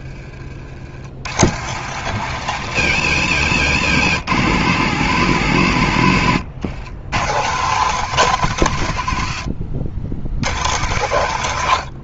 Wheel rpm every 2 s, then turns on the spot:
70, 130, 120, 100, 120, 120.
none